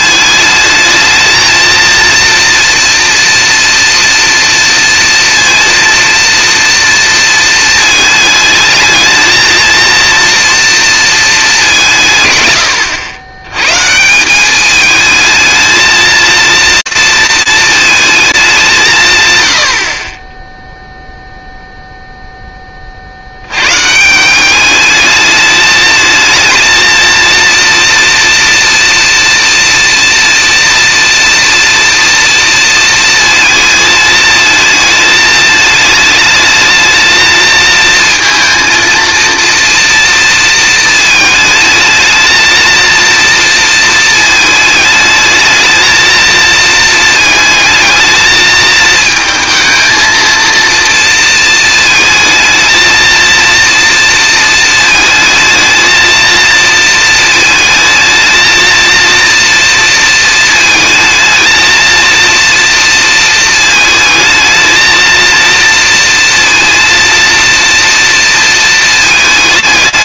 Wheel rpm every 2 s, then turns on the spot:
220, 230, 230, 230, 220, 230, 100, 220, 230, 160, 0, 30, 210, 230, 230, 230, 230, 220, 220, 230, 230, 230, 210, 220, 220, 230, 230, 230, 230, 230, 220, 230, 230, 230, 220.
none